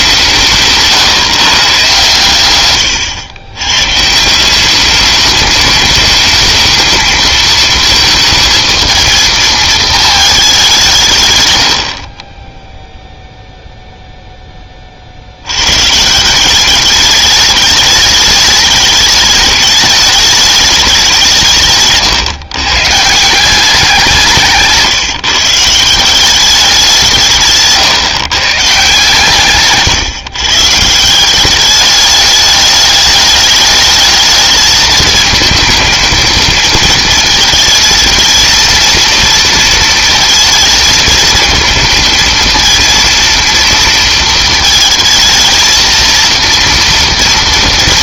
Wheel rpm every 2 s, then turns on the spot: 160, 120, 190, 220, 220, 190, 10, 20, 190, 210, 200, 130, 160, 190, 150, 140, 210, 220, 220, 230, 230, 230, 220, 230.
none